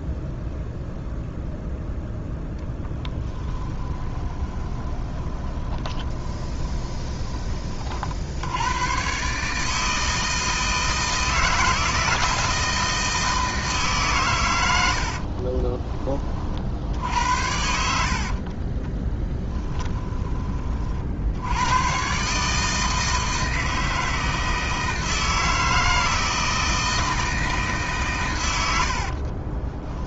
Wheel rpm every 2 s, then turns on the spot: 0, 10, 20, 20, 110, 160, 160, 80, 60, 20, 50, 160, 160, 160, 70.
2-8 14-16 18-20 28-30